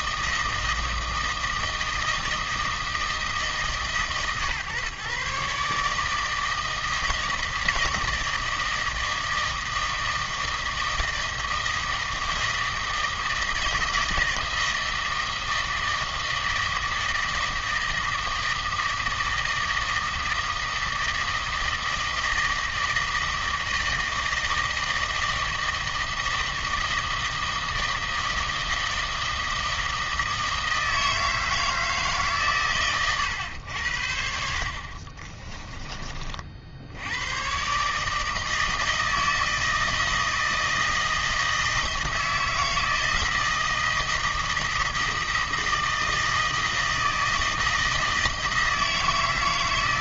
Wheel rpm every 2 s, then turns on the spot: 160, 160, 130, 160, 160, 160, 160, 160, 160, 160, 160, 160, 160, 160, 160, 160, 130, 60, 60, 160, 160, 160, 160, 160, 150.
34-36